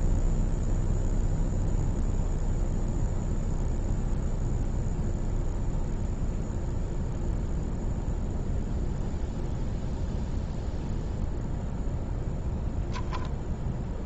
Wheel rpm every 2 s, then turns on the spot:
0, 0, 0, 0, 0, 0, 0.
none